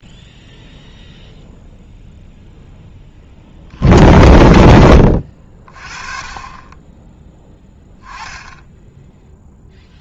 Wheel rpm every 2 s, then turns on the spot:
0, 10, 70, 20, 10.
none